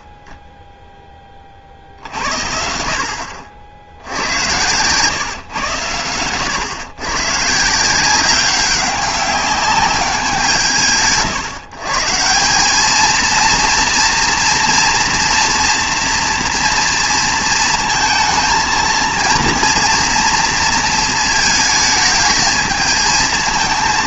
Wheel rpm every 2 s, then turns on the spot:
20, 70, 110, 110, 190, 180, 160, 240, 230, 220, 230, 220.
none